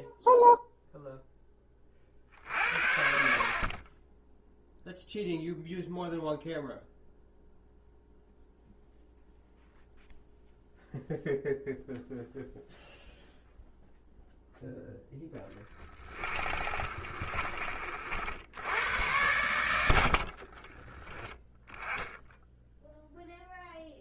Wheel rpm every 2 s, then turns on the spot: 0, 60, 0, 0, 0, 0, 0, 0, 30, 90, 20, 0.
16-18 20-22